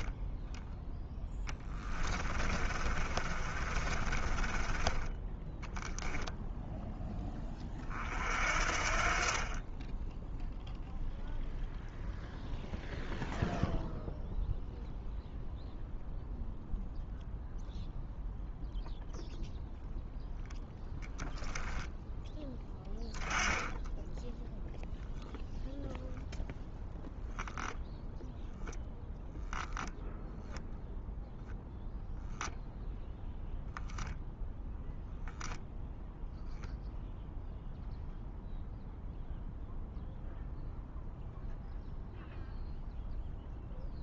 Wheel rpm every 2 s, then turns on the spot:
10, 30, 20, 10, 50, 0, 0, 0, 0, 0, 0, 10, 0, 0, 0, 0, 0, 0, 0, 0, 0, 0.
2-6